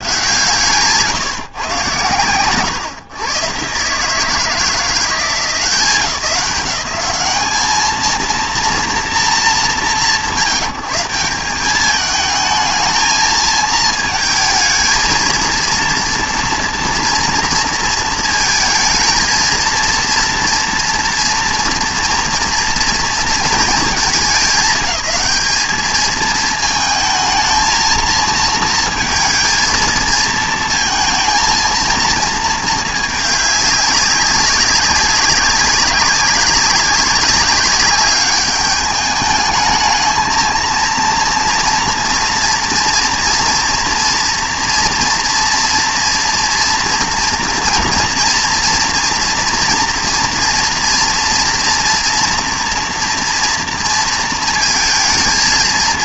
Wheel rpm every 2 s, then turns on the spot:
150, 120, 160, 180, 230, 180, 220, 220, 230, 230, 230, 230, 210, 220, 230, 220, 220, 190, 200, 210, 230, 230, 230, 230, 230, 240, 240, 230.
none